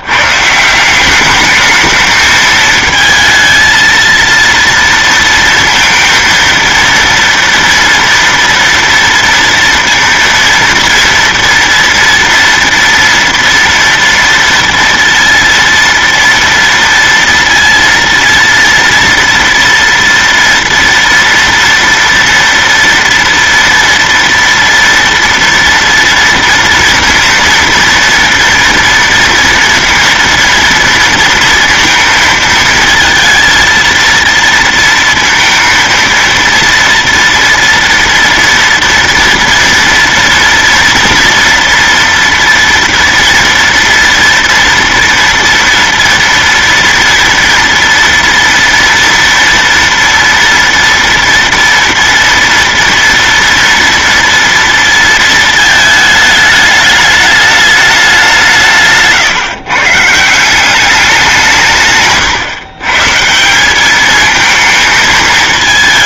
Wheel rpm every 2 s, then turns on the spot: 180, 220, 230, 230, 230, 230, 230, 230, 230, 230, 230, 230, 230, 230, 230, 230, 230, 230, 230, 240, 230, 230, 240, 230, 230, 230, 240, 230, 210, 150, 190, 140, 220.
none